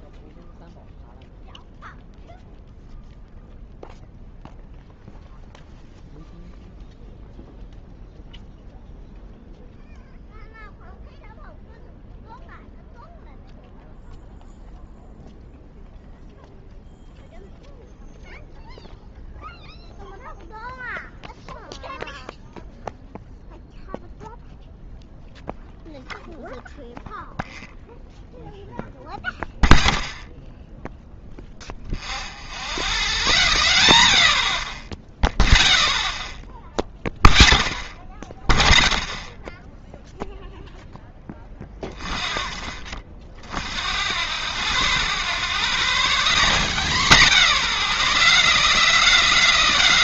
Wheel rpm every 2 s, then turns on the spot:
0, 0, 0, 0, 0, 0, 0, 0, 0, 0, 0, 0, 0, 0, 0, 0, 0, 0, 0, 0, 0, 0, 0, 0, 0.
none